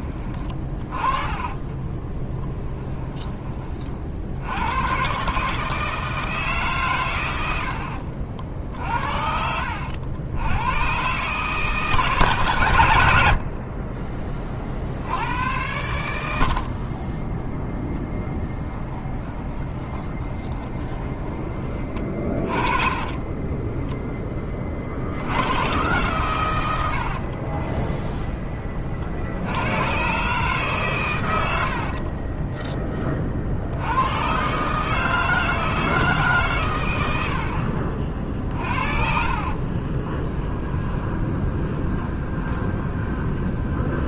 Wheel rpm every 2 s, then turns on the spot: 20, 10, 90, 140, 60, 100, 120, 30, 40, 0, 20, 30, 30, 90, 20, 140, 20, 140, 120, 50, 20, 20.
2-4 20-24 38-44